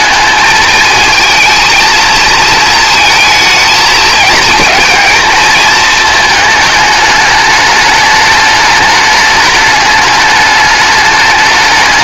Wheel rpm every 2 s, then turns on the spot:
220, 230, 220, 220, 210, 210.
none